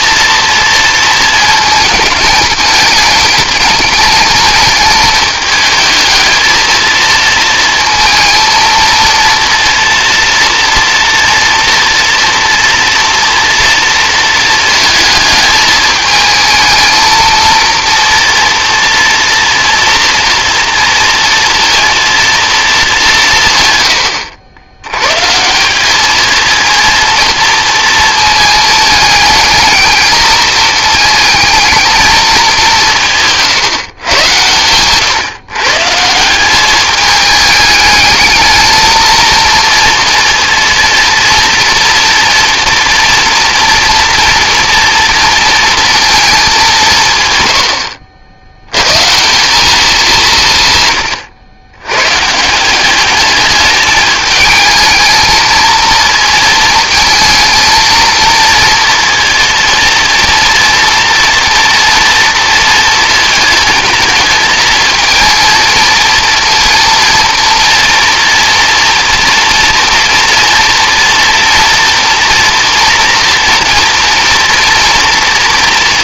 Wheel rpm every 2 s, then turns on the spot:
230, 210, 210, 220, 230, 240, 240, 230, 220, 230, 230, 220, 90, 230, 220, 220, 200, 120, 190, 220, 230, 230, 230, 180, 90, 150, 170, 220, 230, 230, 230, 230, 220, 230, 230, 230, 230, 240.
none